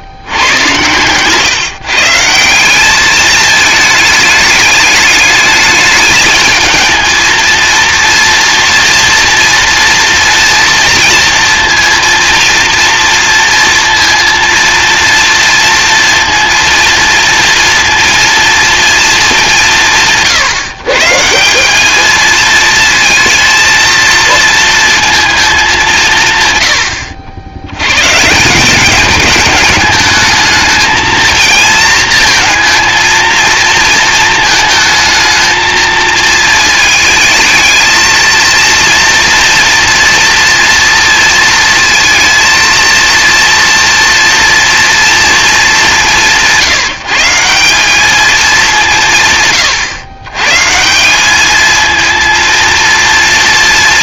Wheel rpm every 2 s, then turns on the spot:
110, 180, 210, 220, 230, 240, 230, 230, 230, 230, 140, 220, 230, 100, 190, 220, 220, 220, 220, 230, 230, 230, 230, 170, 210, 140, 230.
none